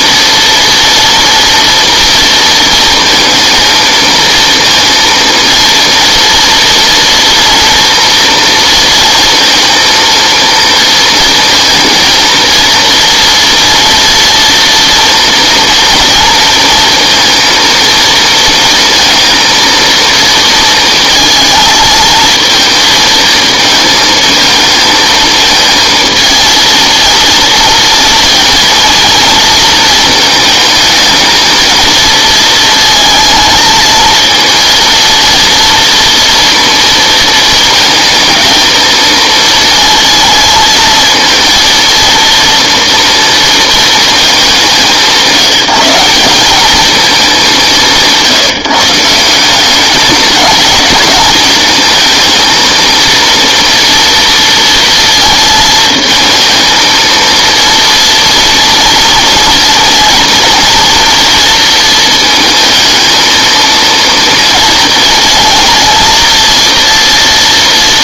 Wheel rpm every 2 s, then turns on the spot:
240, 230, 230, 230, 230, 230, 230, 230, 230, 230, 230, 230, 220, 230, 230, 220, 230, 230, 230, 220, 220, 230, 200, 210, 160, 210, 220, 230, 230, 230, 230, 230, 230, 230.
none